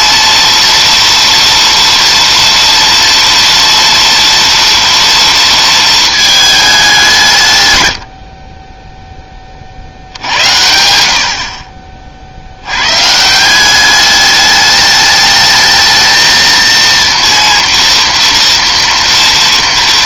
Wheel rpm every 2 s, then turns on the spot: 230, 230, 230, 210, 20, 80, 80, 210, 230, 240.
none